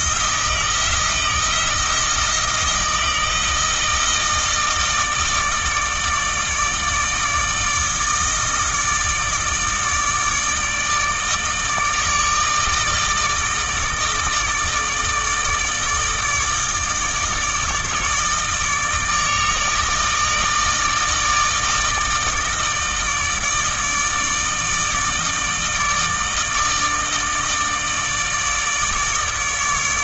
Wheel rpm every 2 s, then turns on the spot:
170, 160, 160, 150, 160, 150, 160, 160, 160, 150, 160, 160, 160, 160, 150.
none